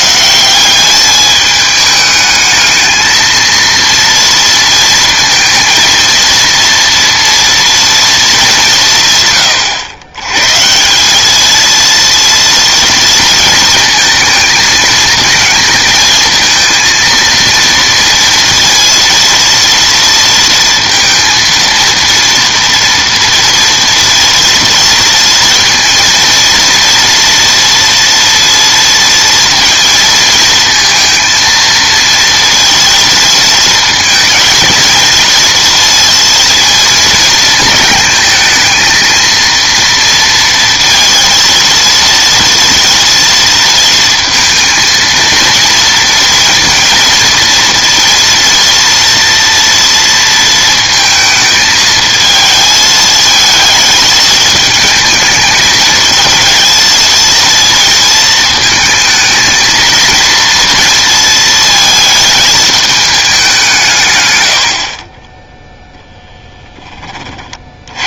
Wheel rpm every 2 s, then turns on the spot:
190, 220, 230, 230, 180, 160, 230, 220, 230, 230, 230, 230, 230, 240, 230, 230, 230, 230, 230, 220, 230, 230, 230, 230, 230, 230, 220, 220, 220, 220, 230, 220, 70, 10.
none